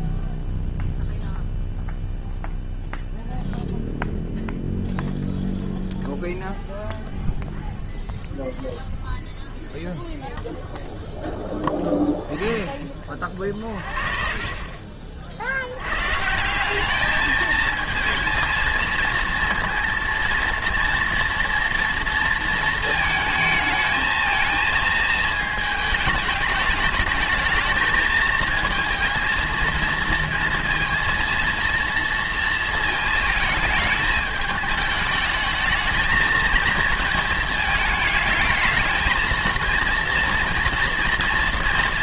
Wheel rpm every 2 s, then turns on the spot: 0, 0, 0, 0, 0, 0, 10, 40, 190, 230, 230, 230, 230, 210, 220, 230, 230, 210, 220, 220, 230.
14-16